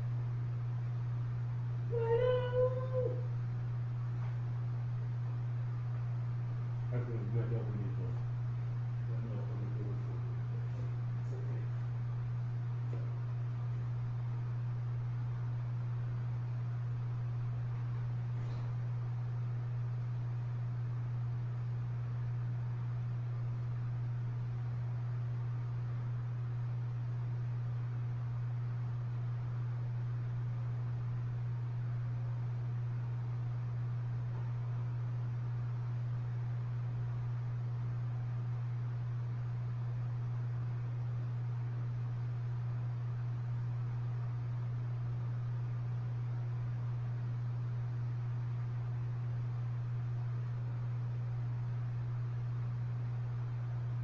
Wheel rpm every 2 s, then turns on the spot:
0, 0, 0, 0, 0, 0, 0, 0, 0, 0, 0, 0, 0, 0, 0, 0, 0, 0, 0, 0, 0, 0, 0, 0, 0, 0, 0.
none